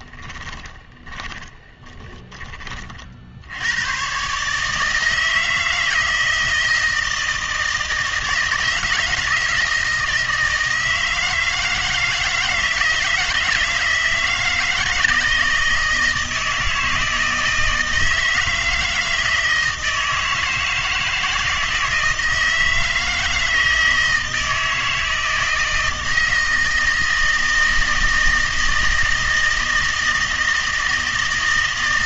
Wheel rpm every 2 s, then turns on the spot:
20, 30, 150, 160, 160, 160, 160, 160, 160, 160, 160, 160, 160, 160, 160, 160.
0-2